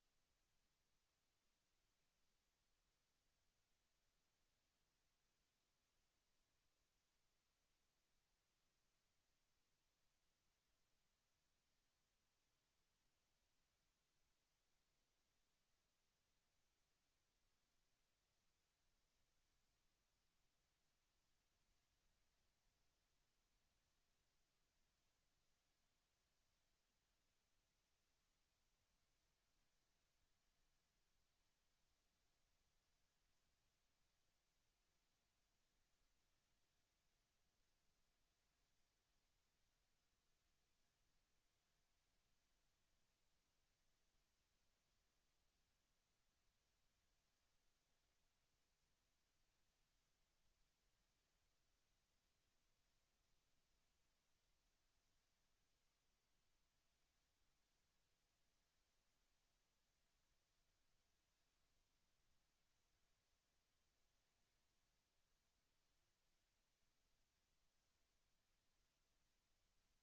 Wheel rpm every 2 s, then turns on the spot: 0, 0, 0, 0, 0, 0, 0, 0, 0, 0, 0, 0, 0, 0, 0, 0, 0, 0, 0, 0, 0, 0, 0, 0, 0, 0, 0, 0, 0, 0, 0, 0, 0, 0, 0.
none